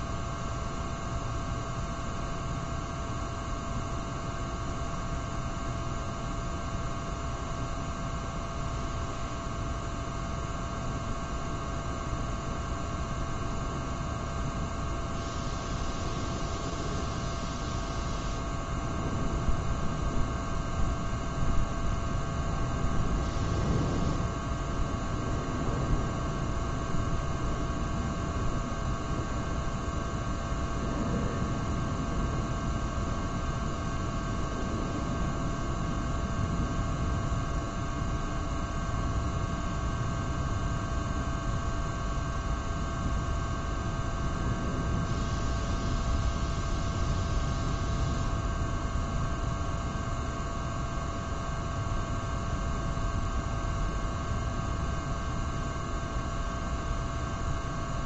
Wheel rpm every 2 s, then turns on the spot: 0, 0, 0, 0, 0, 0, 0, 0, 0, 0, 0, 0, 0, 0, 0, 0, 0, 0, 0, 0, 0, 0, 0, 0, 0, 0, 0, 0, 0.
none